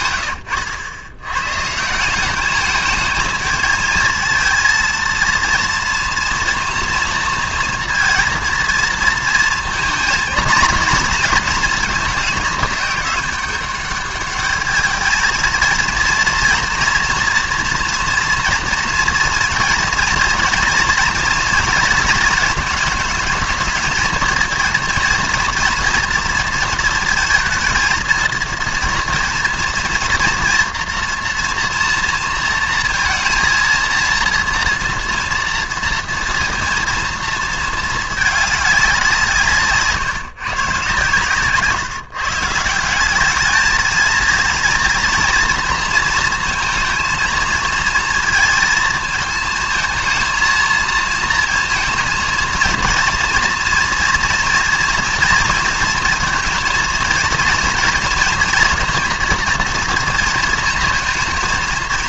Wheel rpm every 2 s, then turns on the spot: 100, 210, 230, 230, 230, 230, 210, 210, 230, 230, 240, 220, 230, 230, 230, 230, 230, 230, 230, 200, 130, 150, 230, 220, 220, 230, 230, 230, 230, 230, 230.
0-2